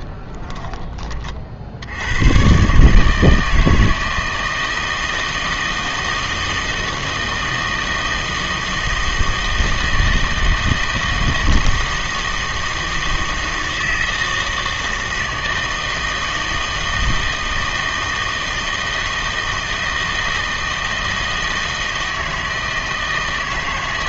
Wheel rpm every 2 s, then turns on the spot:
20, 130, 160, 160, 160, 160, 160, 160, 160, 160, 160, 160.
none